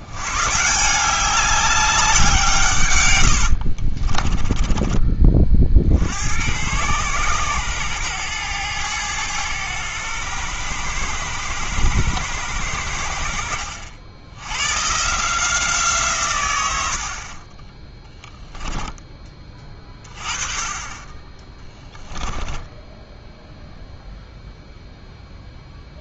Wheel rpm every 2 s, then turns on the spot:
160, 140, 20, 100, 110, 110, 90, 110, 100, 10, 20, 10, 0.
4-6 22-24